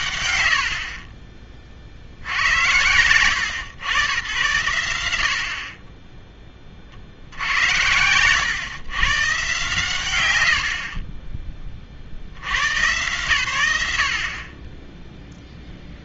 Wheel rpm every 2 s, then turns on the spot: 30, 90, 100, 30, 110, 50, 110, 20.
0-2 10-12